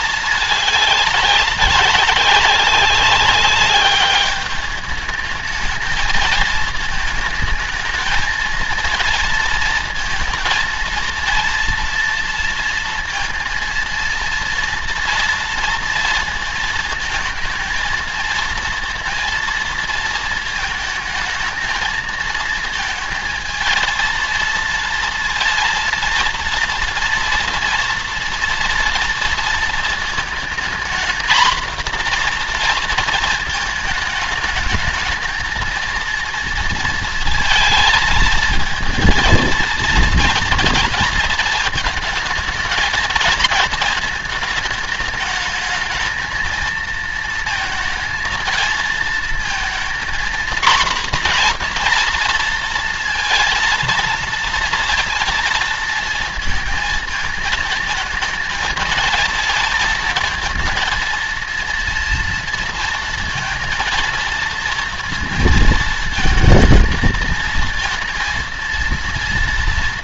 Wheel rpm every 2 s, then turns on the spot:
210, 190, 200, 220, 230, 230, 230, 230, 230, 230, 230, 220, 230, 230, 230, 230, 240, 210, 220, 230, 230, 220, 220, 220, 230, 230, 240, 230, 230, 220, 230, 230, 230, 230, 230.
none